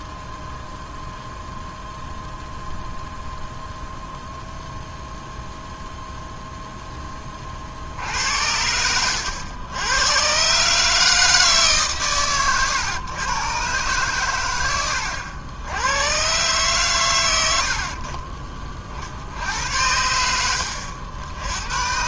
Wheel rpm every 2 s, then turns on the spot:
0, 0, 0, 0, 90, 150, 110, 90, 120, 50, 80.
8-10